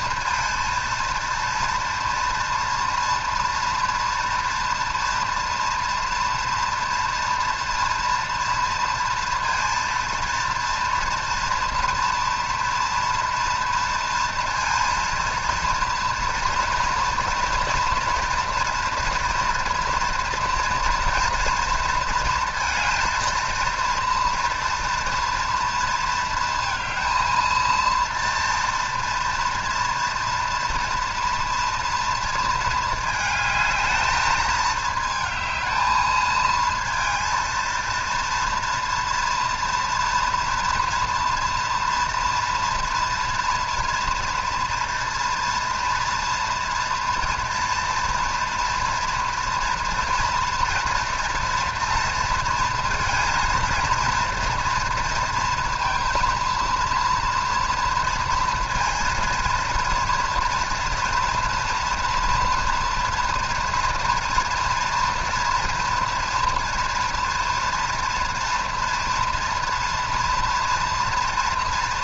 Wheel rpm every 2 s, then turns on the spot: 230, 230, 240, 230, 230, 230, 230, 230, 230, 230, 230, 230, 230, 230, 230, 230, 220, 220, 230, 230, 230, 240, 230, 230, 230, 230, 230, 230, 230, 230, 230, 230, 230, 240, 230, 230.
none